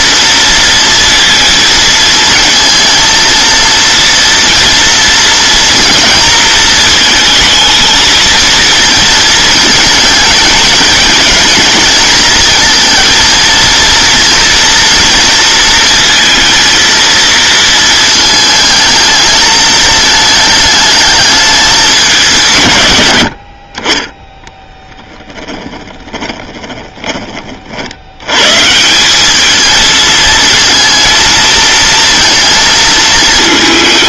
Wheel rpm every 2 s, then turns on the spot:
230, 230, 240, 220, 230, 220, 220, 230, 230, 220, 220, 130, 10, 20, 150, 230, 230.
24-28